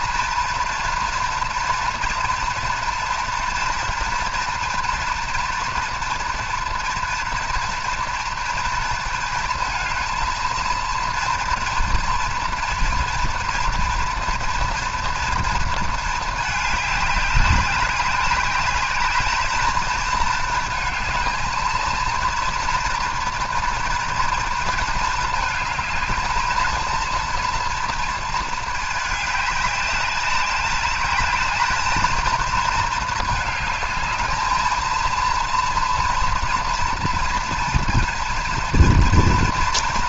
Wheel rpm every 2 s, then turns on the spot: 230, 230, 230, 230, 230, 230, 240, 230, 210, 210, 220, 230, 230, 220, 220, 200, 220, 220, 230, 230.
none